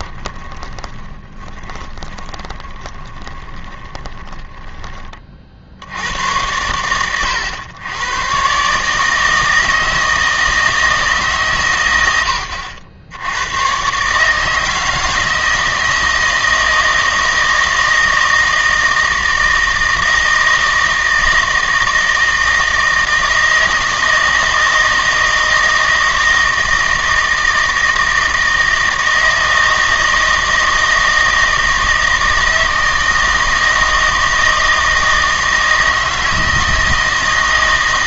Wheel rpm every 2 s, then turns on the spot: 20, 20, 20, 100, 140, 160, 80, 160, 170, 160, 160, 160, 160, 160, 160, 160, 160, 160, 160.
0-6